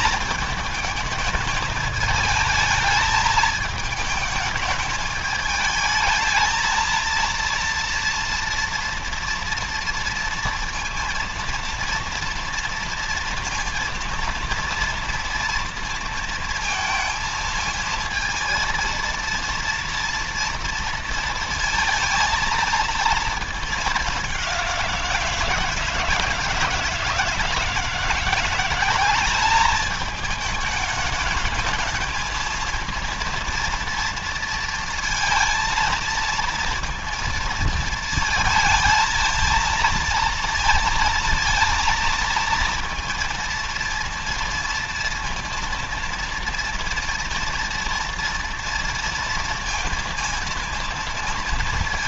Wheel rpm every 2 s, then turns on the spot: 220, 210, 220, 220, 240, 230, 230, 230, 230, 230, 230, 230, 190, 160, 180, 210, 230, 230, 230, 220, 230, 230, 230, 230, 230, 230.
none